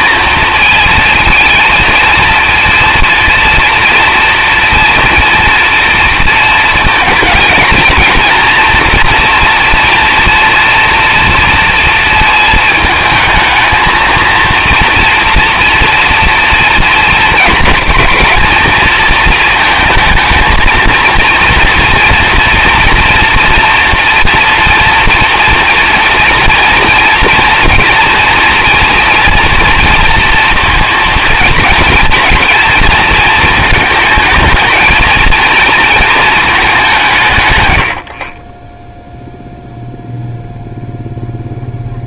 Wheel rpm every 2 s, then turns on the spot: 220, 230, 230, 230, 240, 240, 220, 230, 230, 220, 230, 230, 230, 230, 230, 230, 230, 220, 220, 20, 0.
none